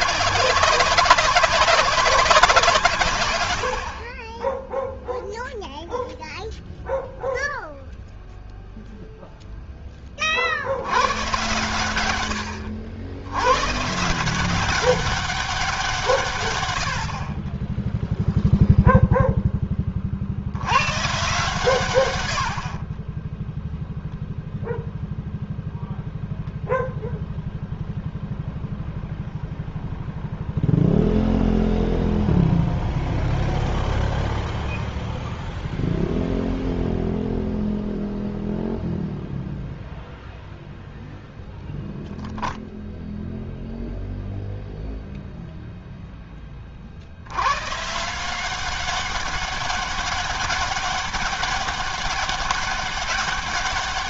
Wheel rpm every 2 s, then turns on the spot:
190, 180, 20, 0, 0, 70, 90, 180, 110, 0, 80, 60, 0, 0, 0, 0, 0, 0, 0, 0, 0, 0, 0, 30, 190, 200, 200.
none